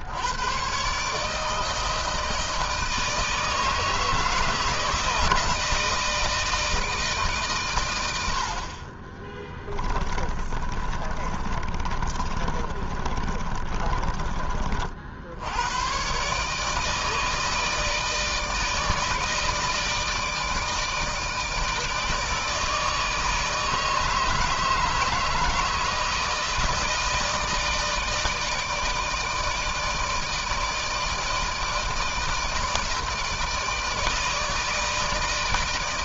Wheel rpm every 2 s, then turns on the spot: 130, 160, 160, 160, 40, 30, 30, 50, 150, 160, 160, 160, 160, 160, 150, 160, 160, 160.
8-14